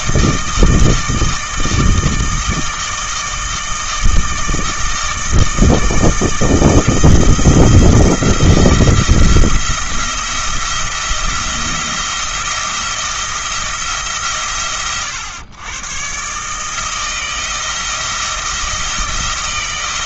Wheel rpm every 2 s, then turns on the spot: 160, 160, 160, 160, 170, 170, 170, 120, 160, 170.
none